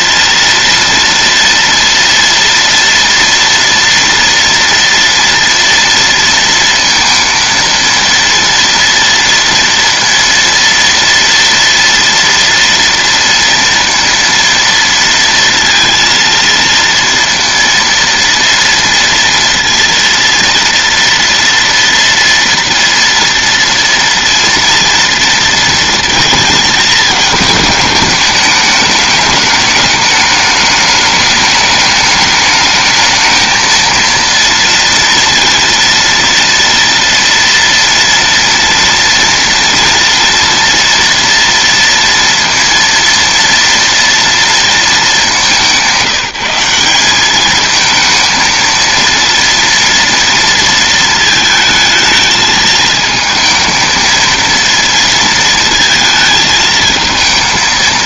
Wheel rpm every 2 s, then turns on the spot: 230, 230, 230, 230, 230, 230, 240, 230, 230, 230, 230, 230, 230, 220, 210, 210, 210, 230, 230, 230, 240, 230, 230, 190, 230, 230, 220, 230, 220.
none